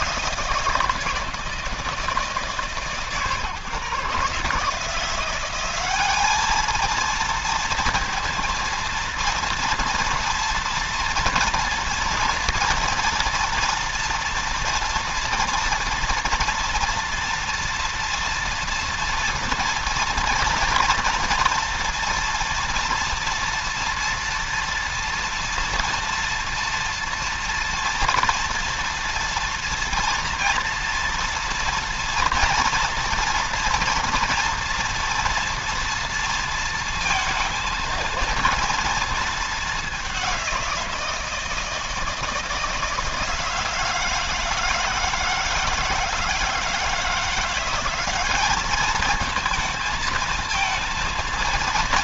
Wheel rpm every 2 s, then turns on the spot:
160, 140, 160, 220, 230, 230, 230, 230, 240, 230, 240, 230, 230, 230, 230, 240, 240, 230, 230, 230, 170, 160, 160, 160, 210, 230.
none